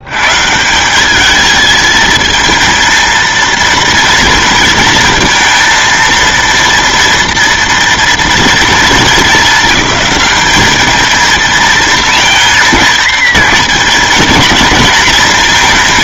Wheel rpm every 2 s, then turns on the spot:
120, 220, 230, 230, 230, 210, 230, 220.
none